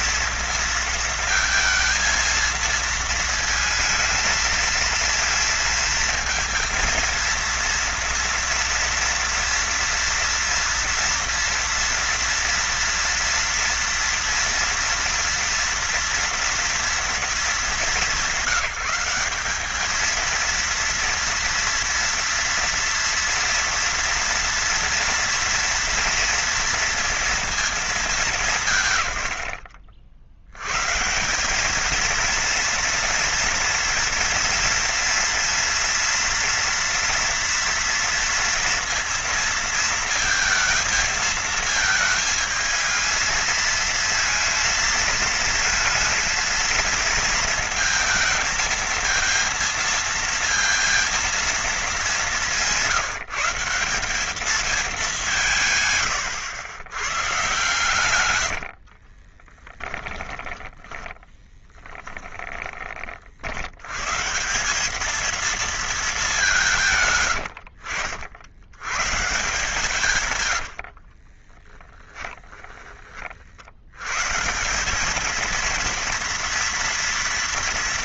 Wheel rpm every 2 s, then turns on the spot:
230, 220, 220, 230, 230, 240, 240, 240, 230, 190, 230, 230, 230, 230, 170, 110, 230, 230, 230, 230, 220, 220, 220, 220, 230, 230, 180, 210, 90, 80, 20, 20, 190, 170, 100, 70, 20, 180, 230.
58-62 70-72